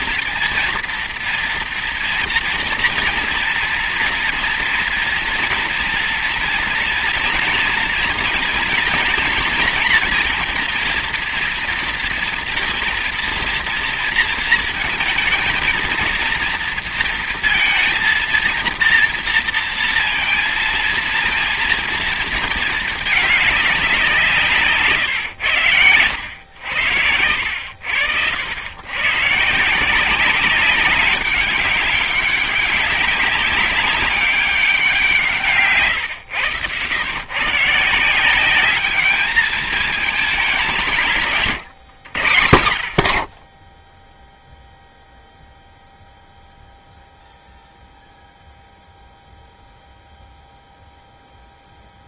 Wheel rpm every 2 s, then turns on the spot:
230, 230, 230, 240, 230, 230, 230, 230, 230, 230, 230, 210, 130, 80, 110, 190, 200, 180, 120, 210, 170, 70, 0, 0, 0, 0.
none